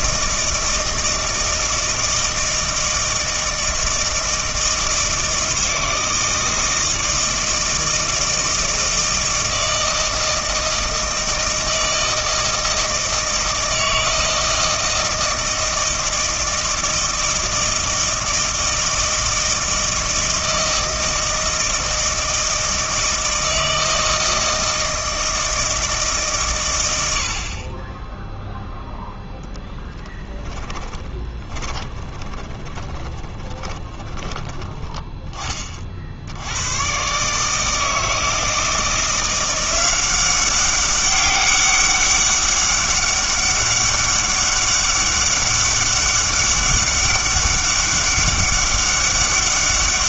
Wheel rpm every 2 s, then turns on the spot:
160, 160, 160, 160, 160, 160, 160, 160, 160, 160, 160, 160, 160, 110, 0, 20, 20, 20, 100, 170, 200, 200, 200, 200, 200.
30-36